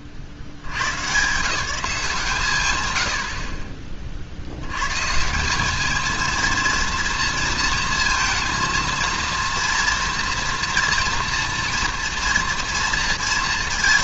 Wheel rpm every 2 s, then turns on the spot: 80, 120, 110, 230, 230, 230, 230.
none